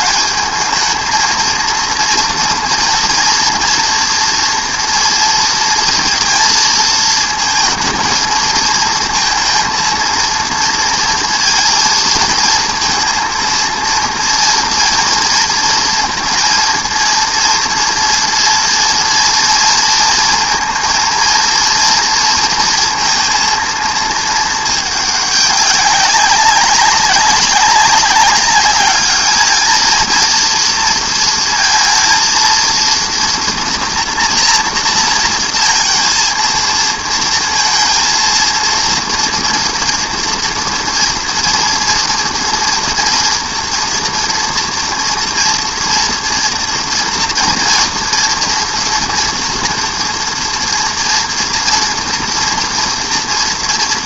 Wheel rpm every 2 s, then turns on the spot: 210, 230, 230, 230, 220, 230, 220, 230, 230, 230, 220, 230, 220, 200, 200, 230, 230, 240, 230, 230, 230, 230, 230, 240, 230, 230, 240.
none